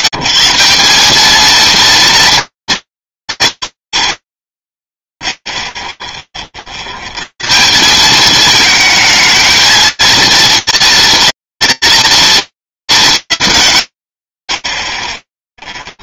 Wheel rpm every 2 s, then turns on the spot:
140, 150, 0, 60, 210, 240, 210, 20.
none